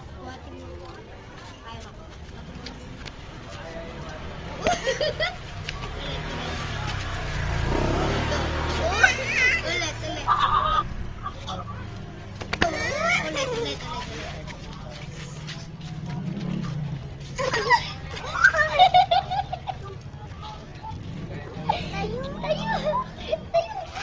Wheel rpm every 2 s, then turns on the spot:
0, 0, 0, 0, 0, 0, 0, 0, 0, 0, 0, 0.
none